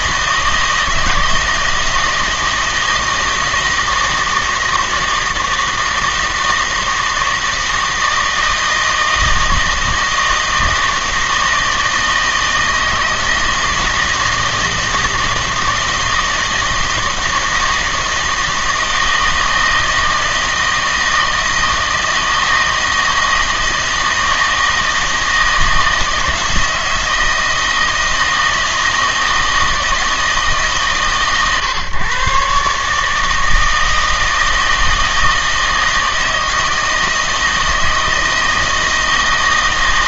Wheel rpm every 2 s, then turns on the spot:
160, 160, 160, 160, 160, 160, 160, 160, 160, 160, 160, 160, 160, 160, 160, 150, 140, 160, 160, 160.
none